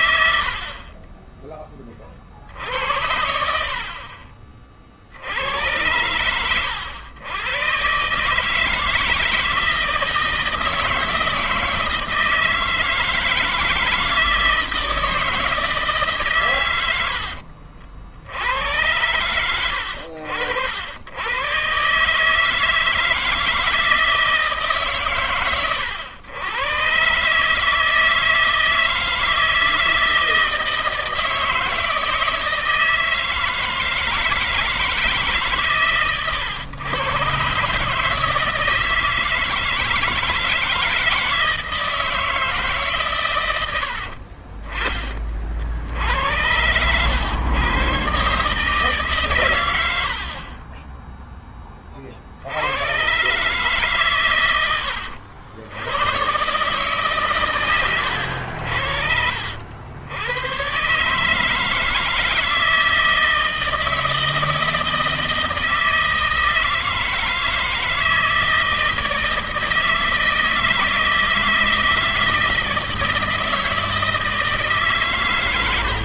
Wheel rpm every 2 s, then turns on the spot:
40, 60, 60, 90, 160, 160, 160, 160, 80, 90, 90, 160, 140, 120, 160, 160, 160, 160, 110, 160, 160, 140, 40, 100, 150, 20, 90, 90, 140, 80, 130, 160, 160, 160, 160, 160, 160, 150.
0-2 16-18